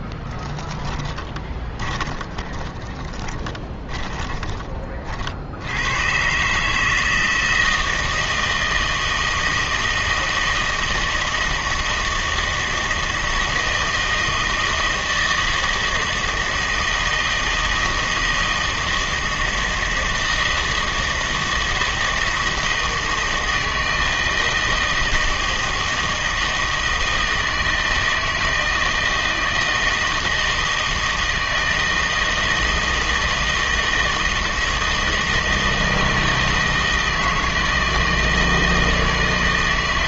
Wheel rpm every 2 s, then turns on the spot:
10, 10, 30, 150, 160, 160, 160, 160, 160, 160, 160, 160, 160, 160, 160, 160, 160, 160, 160, 160.
0-4